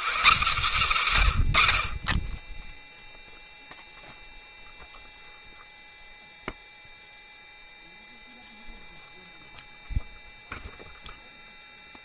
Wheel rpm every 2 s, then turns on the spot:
110, 0, 0, 0, 0, 0.
none